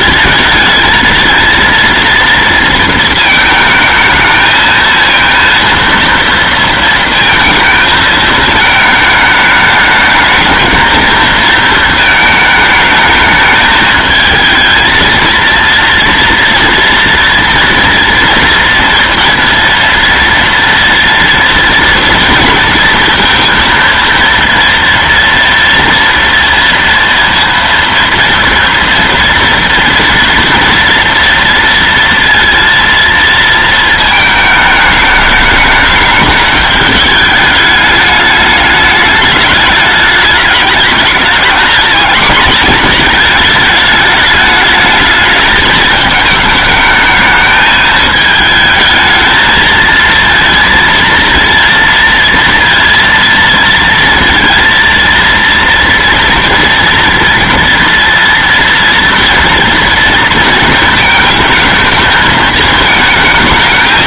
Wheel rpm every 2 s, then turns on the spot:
220, 230, 220, 230, 220, 220, 220, 220, 230, 230, 230, 230, 230, 230, 230, 240, 230, 220, 210, 210, 210, 220, 210, 220, 220, 230, 230, 230, 230, 230, 230, 220.
none